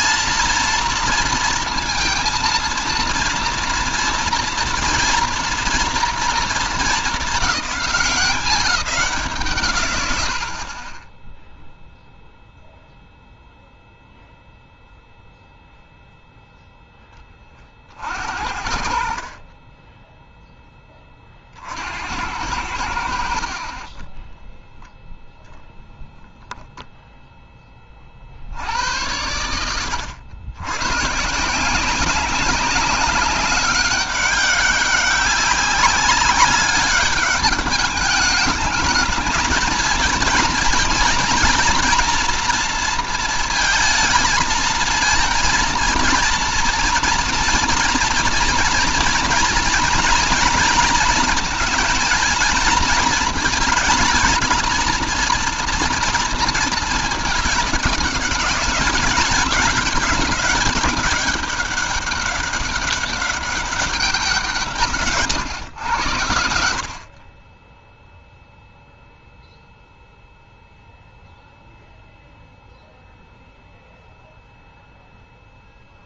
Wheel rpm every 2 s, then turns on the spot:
230, 230, 230, 220, 180, 80, 0, 0, 0, 50, 10, 80, 10, 0, 40, 110, 190, 200, 200, 210, 230, 230, 230, 230, 230, 230, 220, 230, 230, 210, 200, 200, 180, 80, 0, 0, 0, 0.
24-26